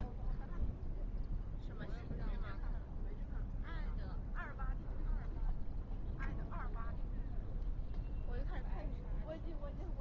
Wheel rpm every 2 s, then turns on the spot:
0, 0, 0, 0, 0.
none